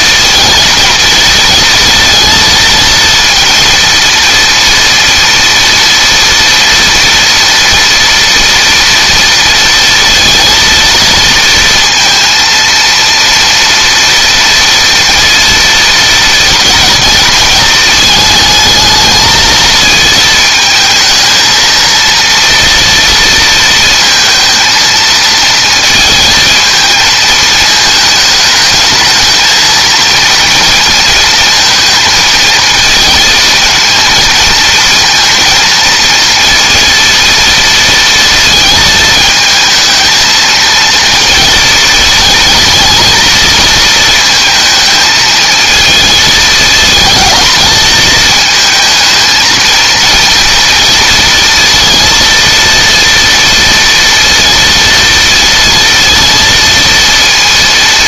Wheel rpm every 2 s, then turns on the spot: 230, 230, 230, 230, 230, 230, 230, 230, 230, 220, 220, 230, 230, 220, 220, 220, 230, 230, 230, 220, 230, 220, 220, 220, 220, 230, 230, 230, 230.
none